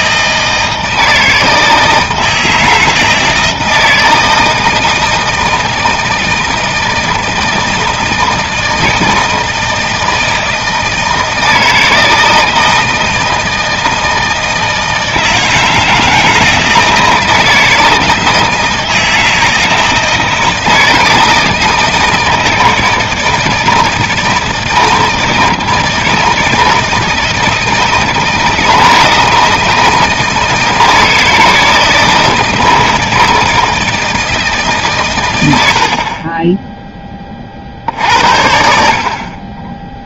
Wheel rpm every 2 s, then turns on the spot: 160, 160, 160, 160, 160, 160, 160, 160, 160, 160, 160, 160, 160, 160, 160, 160, 160, 150, 10, 70.
none